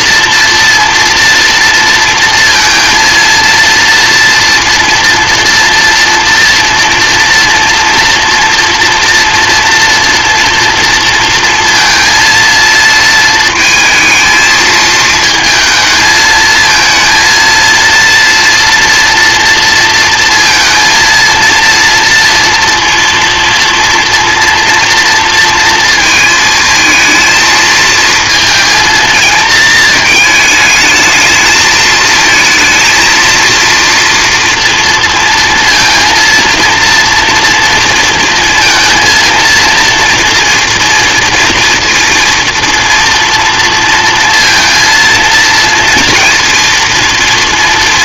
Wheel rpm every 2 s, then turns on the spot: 230, 230, 230, 230, 230, 230, 230, 220, 220, 230, 230, 230, 230, 220, 230, 220, 230, 230, 230, 230, 230, 230, 230, 230.
none